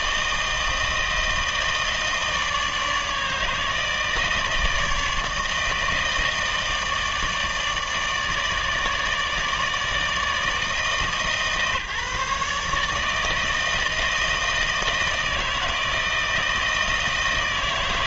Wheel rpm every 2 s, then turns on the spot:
160, 150, 160, 160, 150, 160, 150, 160, 160.
none